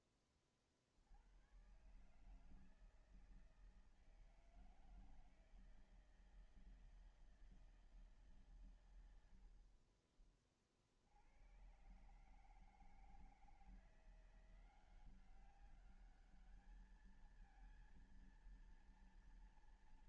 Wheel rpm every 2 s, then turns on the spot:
30, 150, 160, 160, 140, 40, 140, 170, 210, 230.
none